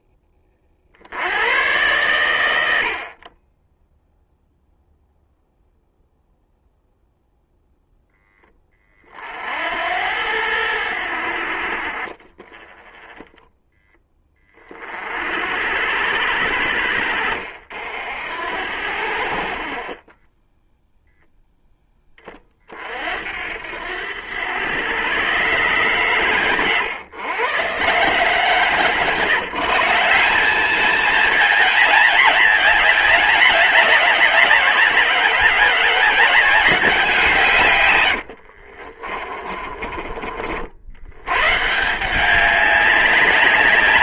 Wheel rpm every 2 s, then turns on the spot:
60, 50, 0, 0, 40, 80, 20, 40, 80, 70, 0, 60, 120, 120, 130, 210, 210, 180, 180, 40, 80, 200.
38-40